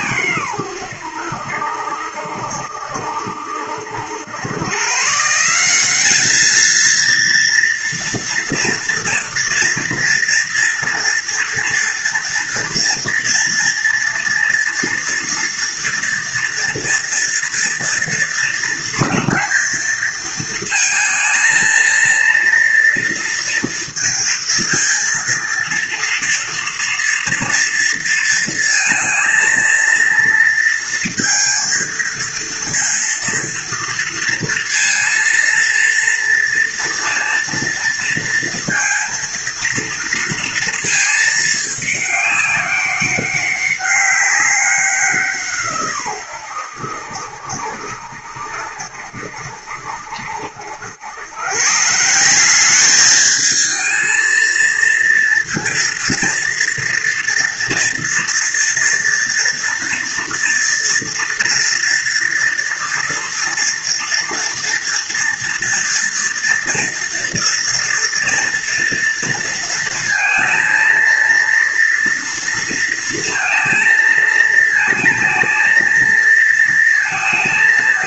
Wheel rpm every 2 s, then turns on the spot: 100, 70, 120, 220, 230, 230, 230, 230, 240, 230, 220, 230, 230, 230, 230, 230, 230, 230, 230, 230, 220, 200, 180, 80, 70, 100, 200, 230, 230, 230, 230, 230, 230, 230, 230, 230, 230, 220, 230.
none